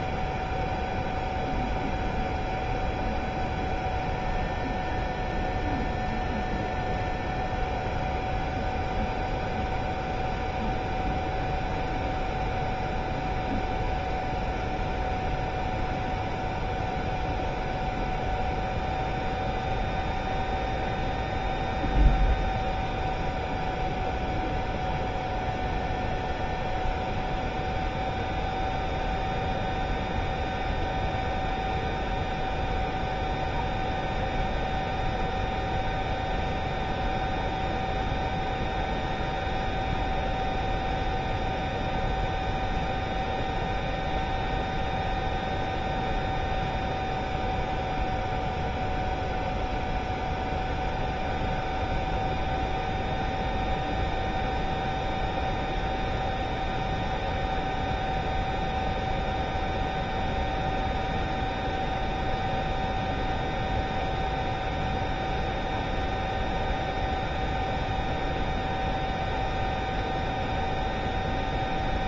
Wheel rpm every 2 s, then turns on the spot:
0, 0, 0, 0, 0, 0, 0, 0, 0, 0, 0, 0, 0, 0, 0, 0, 0, 0, 0, 0, 0, 0, 0, 0, 0, 0, 0, 0, 0, 0, 0, 0, 0, 0, 0, 0.
none